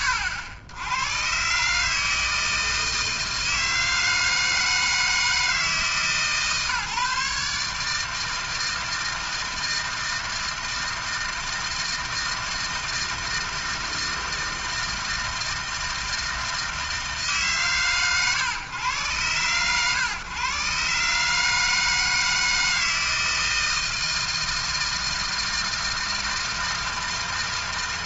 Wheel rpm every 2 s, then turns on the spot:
90, 160, 160, 140, 160, 160, 160, 160, 160, 110, 130, 160, 160, 160.
none